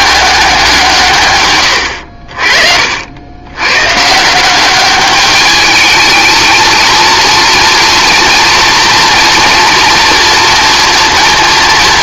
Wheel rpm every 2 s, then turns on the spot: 180, 50, 190, 220, 230, 230.
none